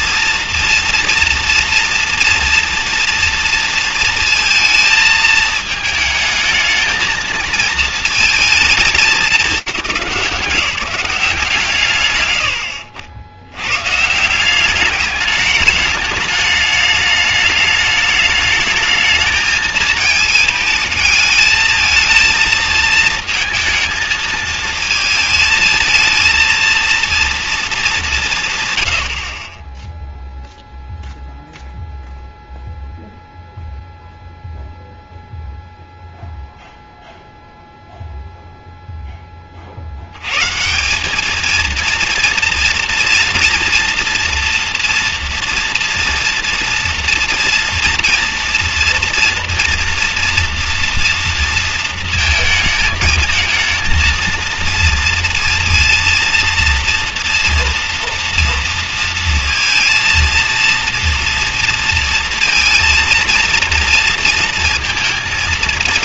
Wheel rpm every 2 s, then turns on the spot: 230, 230, 230, 220, 220, 180, 70, 200, 210, 210, 220, 220, 220, 230, 110, 0, 0, 0, 0, 10, 200, 230, 230, 230, 230, 230, 220, 230, 230, 230, 240, 230, 230.
none